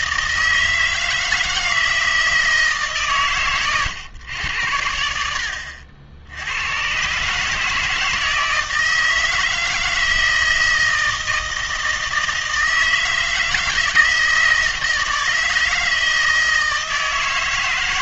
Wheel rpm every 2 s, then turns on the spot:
160, 160, 100, 90, 160, 160, 160, 160, 160.
none